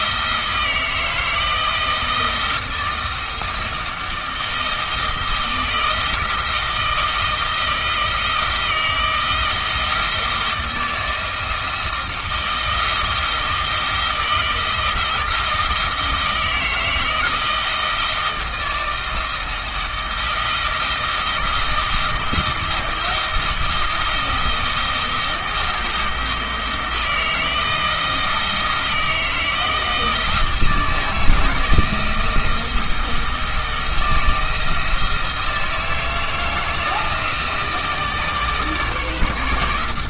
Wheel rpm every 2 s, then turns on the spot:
160, 160, 160, 160, 160, 170, 160, 160, 160, 160, 160, 170, 170, 160, 160, 160, 160, 160, 160, 150.
none